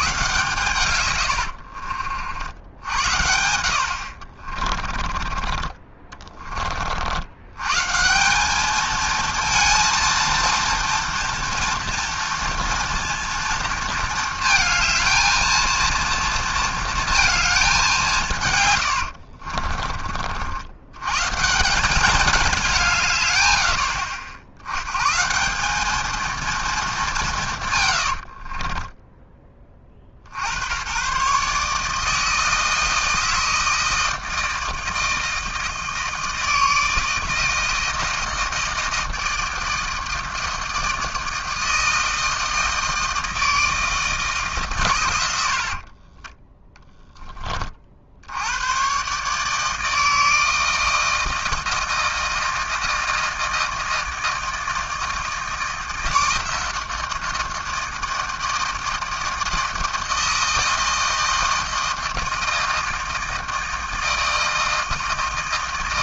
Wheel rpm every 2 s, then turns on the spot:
120, 70, 30, 20, 200, 230, 230, 220, 230, 140, 80, 190, 70, 220, 40, 80, 160, 160, 160, 160, 160, 160, 150, 20, 90, 160, 160, 160, 160, 160, 160, 160, 160.
4-6 28-30 46-48